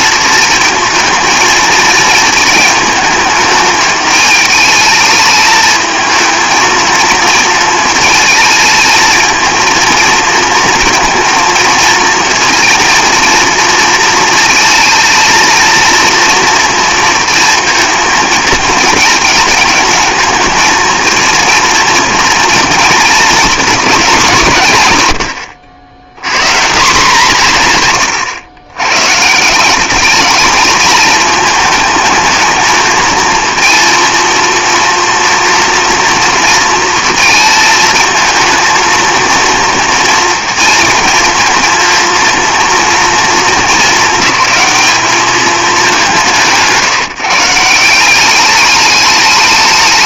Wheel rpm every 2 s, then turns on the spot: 220, 220, 220, 220, 220, 230, 230, 230, 230, 220, 220, 220, 130, 180, 120, 220, 220, 230, 230, 220, 230, 230, 220, 170, 200.
none